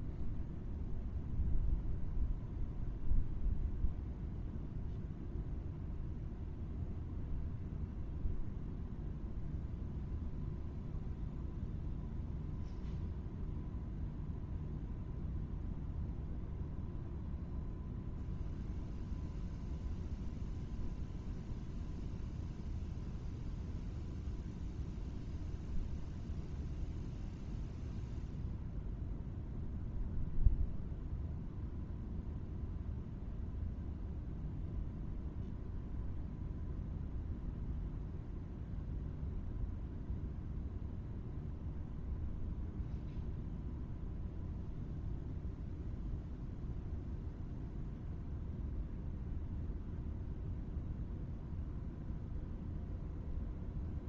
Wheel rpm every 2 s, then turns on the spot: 0, 0, 0, 0, 0, 0, 0, 0, 0, 0, 0, 0, 0, 0, 0, 0, 0, 0, 0, 0, 0, 0, 0, 0, 0, 0, 0.
none